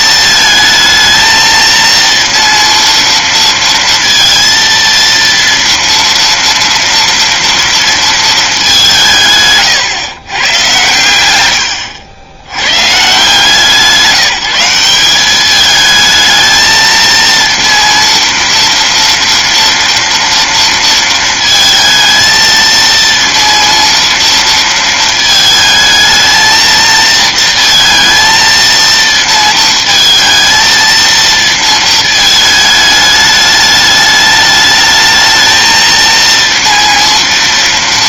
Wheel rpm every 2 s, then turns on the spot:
220, 230, 230, 230, 200, 110, 110, 180, 220, 230, 230, 230, 230, 230, 230, 220, 220, 210, 230.
none